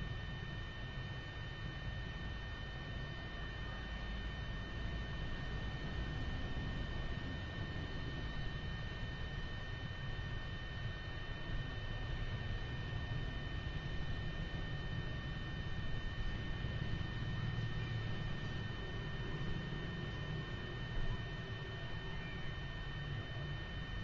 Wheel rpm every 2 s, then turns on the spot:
0, 0, 0, 0, 0, 0, 0, 0, 0, 0, 0, 0.
none